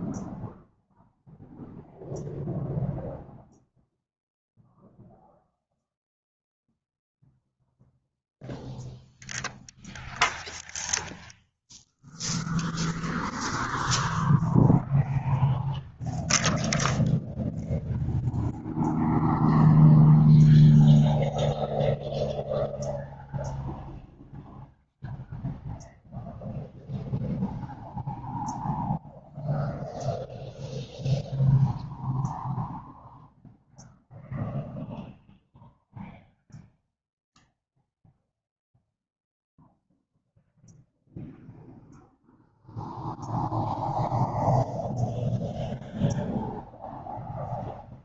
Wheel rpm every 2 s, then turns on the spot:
0, 0, 0, 0, 0, 0, 0, 0, 0, 0, 0, 0, 0, 0, 0, 0, 0, 0, 0, 0, 0, 0, 0, 0.
none